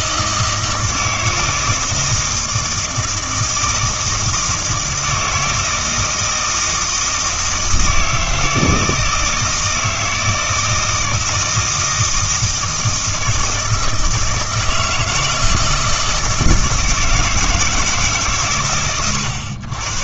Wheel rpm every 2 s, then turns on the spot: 160, 160, 160, 160, 160, 160, 160, 160, 160, 110.
none